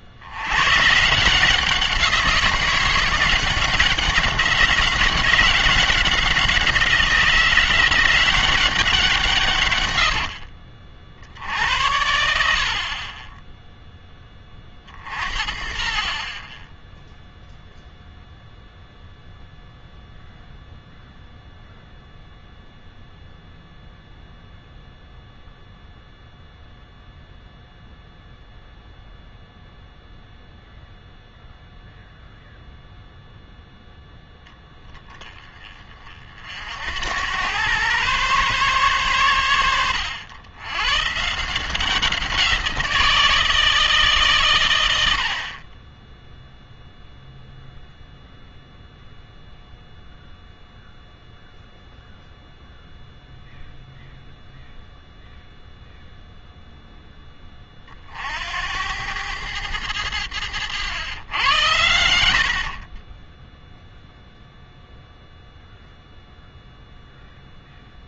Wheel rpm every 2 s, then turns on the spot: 120, 180, 190, 180, 190, 40, 50, 40, 10, 0, 0, 0, 0, 0, 0, 0, 0, 10, 70, 130, 120, 170, 110, 0, 0, 0, 0, 0, 0, 80, 100, 40, 0, 0.
none